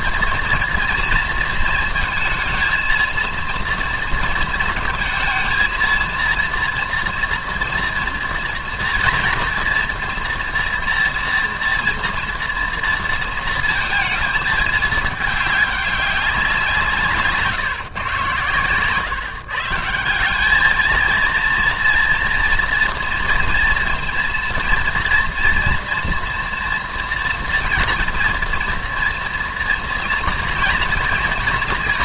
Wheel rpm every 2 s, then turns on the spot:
230, 220, 230, 230, 240, 240, 230, 220, 180, 120, 210, 230, 230, 240, 240, 230.
none